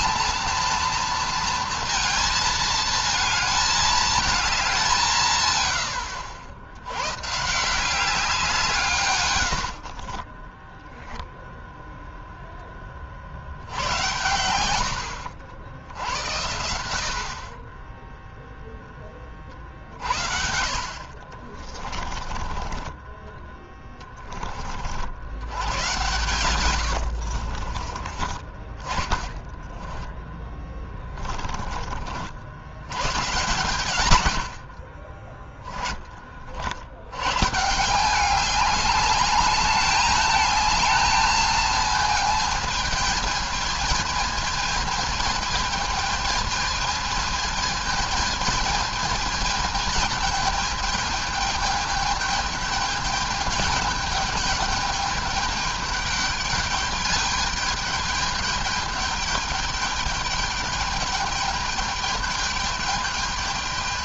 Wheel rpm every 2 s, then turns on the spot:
230, 220, 200, 70, 170, 20, 10, 90, 90, 0, 60, 20, 50, 120, 20, 10, 80, 70, 50, 190, 220, 220, 220, 220, 220, 220, 210, 210, 210, 210, 210, 210.
10-12 22-24 26-28 30-32